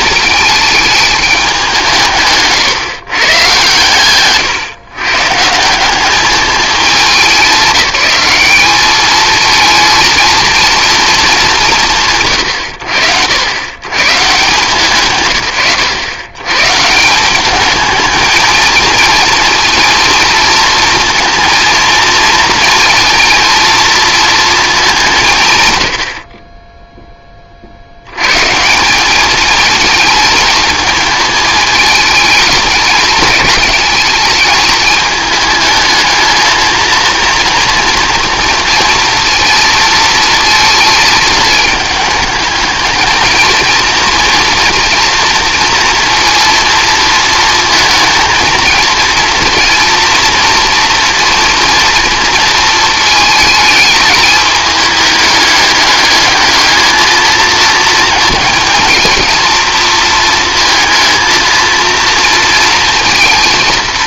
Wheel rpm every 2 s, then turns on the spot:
210, 130, 120, 200, 200, 230, 100, 160, 140, 220, 230, 230, 210, 20, 170, 220, 210, 210, 230, 230, 220, 220, 230, 230, 230, 240, 230, 210, 220, 230, 230, 230.
none